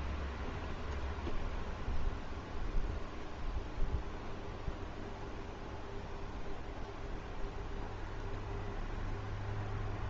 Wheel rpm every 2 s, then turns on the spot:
0, 0, 0, 0, 0.
none